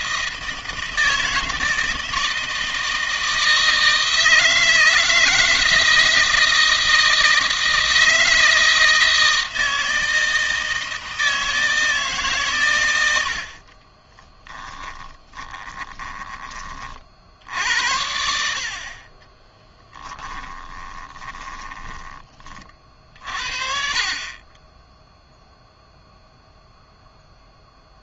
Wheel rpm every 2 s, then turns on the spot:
160, 160, 160, 160, 160, 160, 110, 10, 40, 50, 30, 50, 10, 0.
14-16 18-22